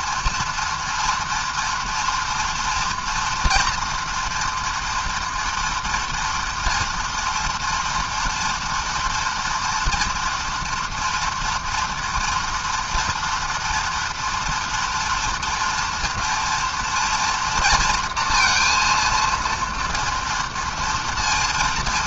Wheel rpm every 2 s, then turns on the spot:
240, 230, 230, 230, 230, 230, 230, 230, 240, 230, 230.
none